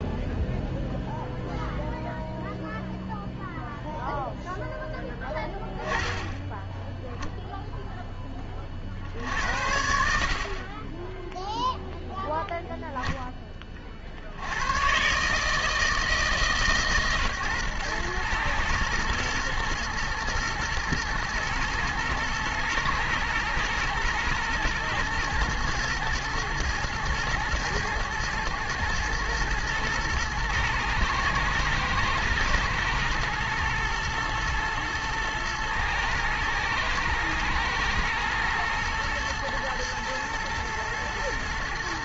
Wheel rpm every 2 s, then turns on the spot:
0, 0, 0, 10, 20, 60, 0, 80, 140, 110, 120, 120, 120, 110, 110, 110, 110, 110, 110, 120, 110.
none